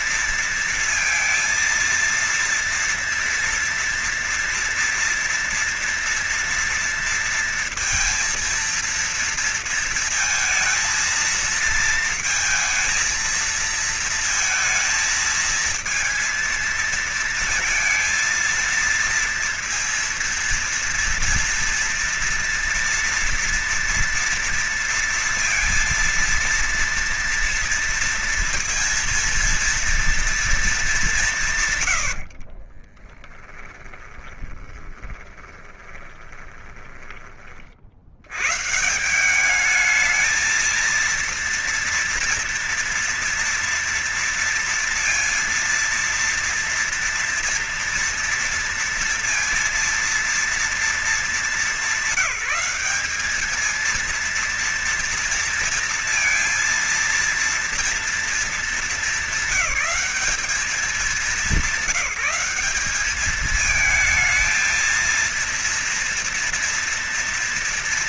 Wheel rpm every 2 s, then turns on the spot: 230, 230, 230, 240, 230, 230, 230, 230, 230, 230, 230, 230, 230, 230, 230, 230, 80, 20, 20, 90, 220, 230, 230, 230, 230, 230, 210, 230, 230, 230, 210, 190, 220, 230.
32-38